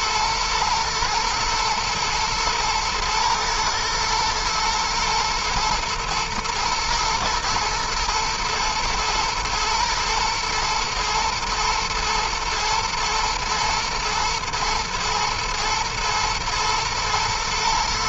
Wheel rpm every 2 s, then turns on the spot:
110, 110, 110, 110, 110, 110, 120, 110, 120.
none